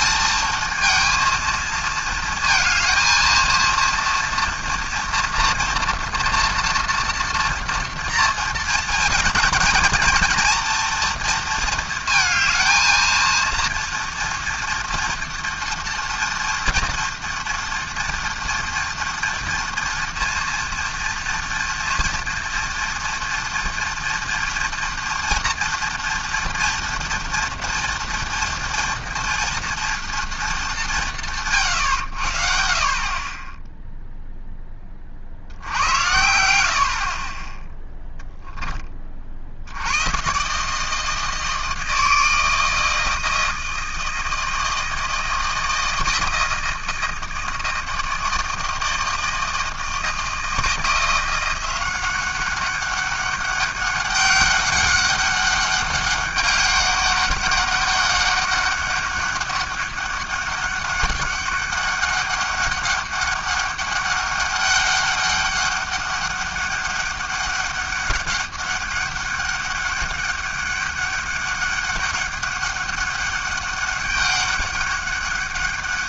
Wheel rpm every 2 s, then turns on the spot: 230, 230, 240, 240, 230, 230, 220, 230, 240, 230, 230, 230, 230, 230, 230, 150, 40, 10, 70, 20, 150, 160, 160, 160, 160, 170, 200, 200, 200, 200, 200, 200, 200, 200, 200, 200, 200, 200.
none